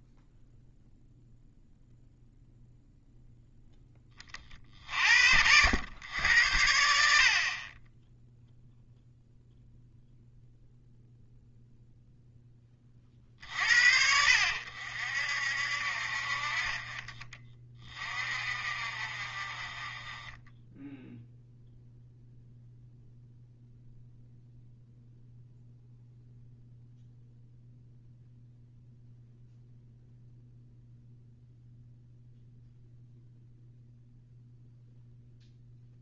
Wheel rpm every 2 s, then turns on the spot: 0, 0, 50, 70, 0, 0, 20, 60, 30, 40, 10, 0, 0, 0, 0, 0, 0, 0.
none